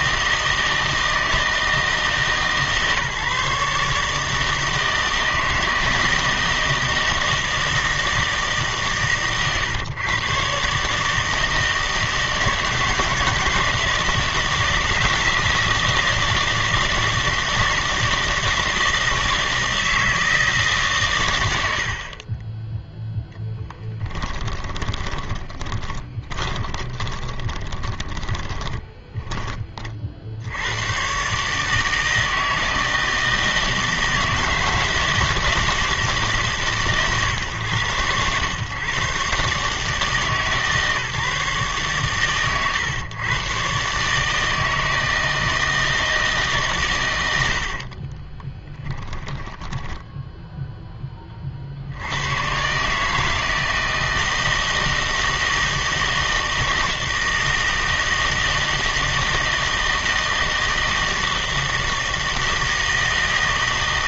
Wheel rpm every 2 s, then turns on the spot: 160, 140, 160, 160, 150, 130, 160, 160, 160, 160, 140, 10, 10, 20, 20, 100, 160, 160, 140, 120, 150, 120, 160, 140, 10, 10, 130, 160, 160, 160, 160, 160.
22-30 48-50